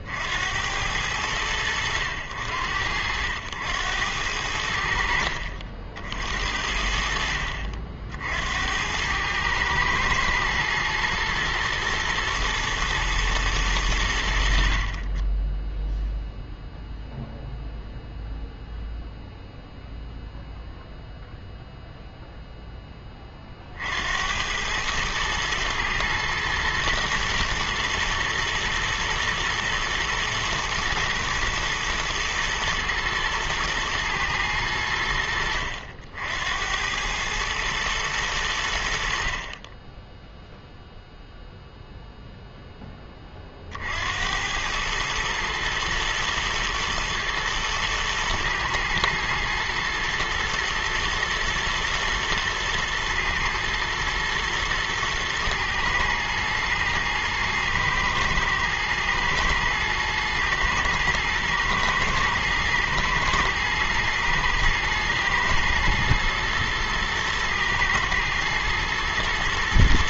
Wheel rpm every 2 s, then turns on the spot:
80, 80, 80, 70, 80, 110, 120, 60, 0, 0, 0, 0, 100, 110, 110, 110, 110, 100, 80, 90, 0, 10, 100, 120, 110, 110, 110, 110, 110, 110, 110, 110, 110, 110, 110.
none